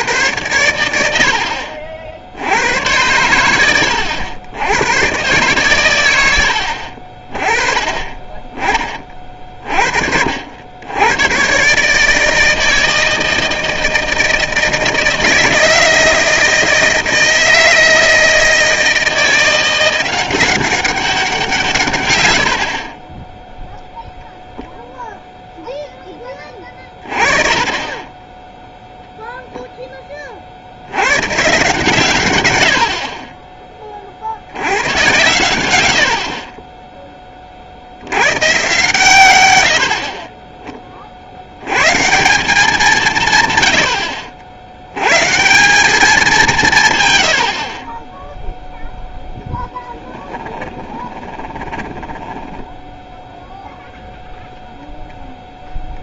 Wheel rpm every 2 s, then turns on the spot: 50, 100, 130, 30, 40, 120, 160, 160, 160, 170, 170, 10, 0, 30, 0, 110, 40, 120, 20, 140, 30, 170, 90, 140, 0, 10, 10, 0.
50-54